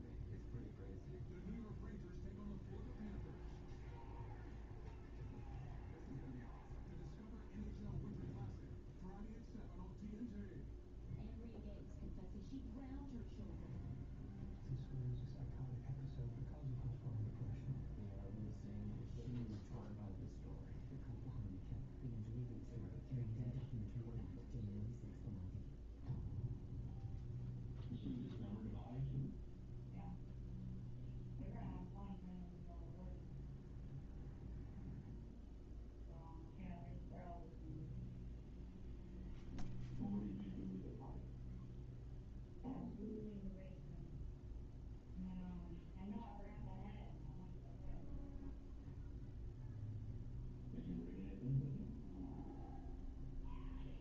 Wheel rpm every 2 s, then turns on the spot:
0, 0, 0, 0, 0, 0, 0, 0, 0, 0, 0, 0, 0, 0, 0, 0, 0, 0, 0, 0, 0, 0, 0, 0, 0, 0, 0.
none